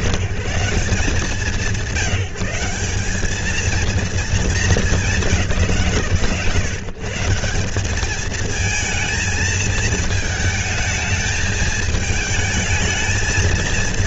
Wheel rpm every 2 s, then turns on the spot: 160, 180, 220, 110, 220, 220, 220.
none